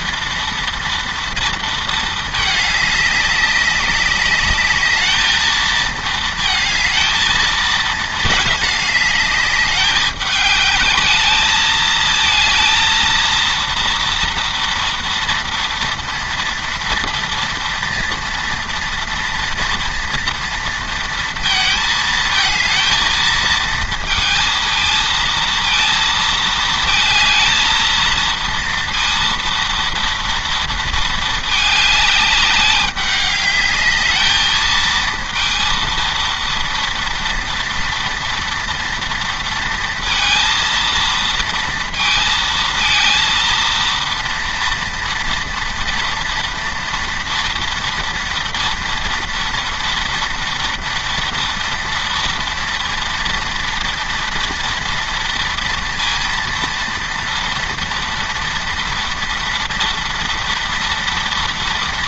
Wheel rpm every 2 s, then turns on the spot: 230, 210, 210, 220, 210, 210, 230, 230, 230, 230, 230, 220, 230, 220, 230, 230, 200, 220, 230, 230, 230, 230, 230, 230, 230, 240, 230, 230, 230, 230, 230.
none